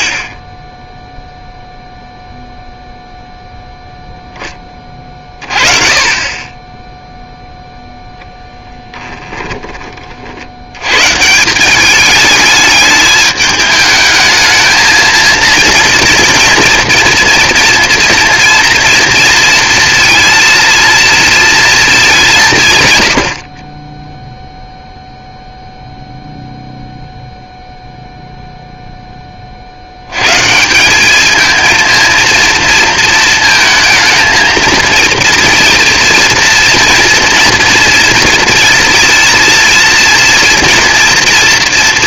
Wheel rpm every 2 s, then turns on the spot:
30, 0, 20, 10, 10, 100, 210, 220, 230, 230, 230, 150, 0, 0, 0, 160, 230, 220, 230, 230, 240.
8-10